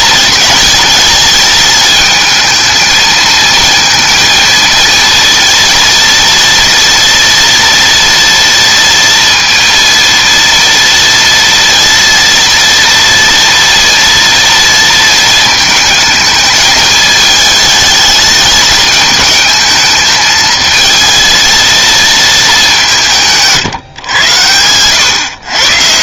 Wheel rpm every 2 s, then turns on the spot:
220, 220, 230, 230, 230, 230, 230, 230, 210, 210, 220, 200, 110.
none